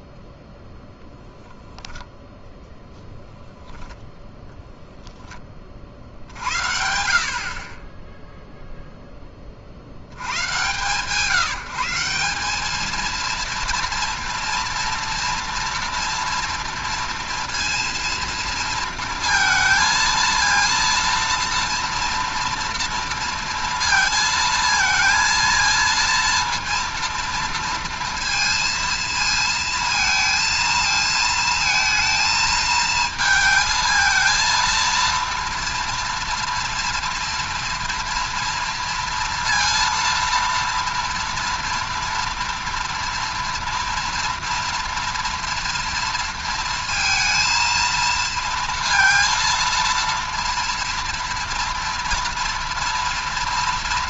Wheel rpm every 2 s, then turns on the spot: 0, 0, 0, 70, 0, 120, 200, 230, 230, 230, 230, 230, 230, 230, 230, 230, 220, 230, 230, 230, 230, 230, 230, 230, 230, 230, 230.
none